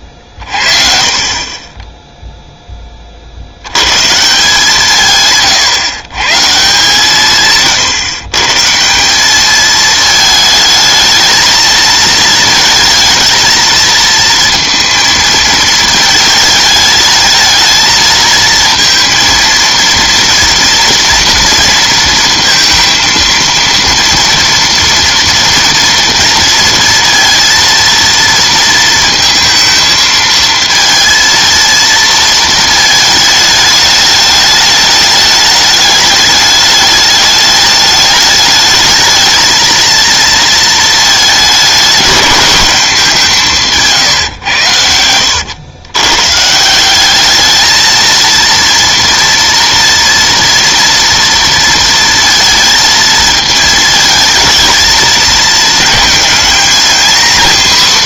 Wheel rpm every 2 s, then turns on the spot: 40, 10, 160, 160, 160, 220, 220, 230, 220, 230, 230, 230, 230, 230, 230, 220, 220, 210, 210, 220, 220, 200, 110, 170, 240, 230, 230, 220, 230.
none